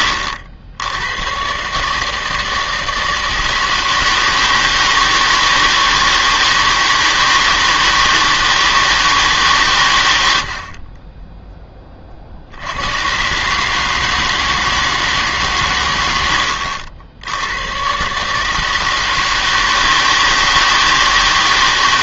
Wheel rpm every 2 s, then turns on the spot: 80, 160, 160, 160, 160, 60, 80, 160, 70, 160, 160.
none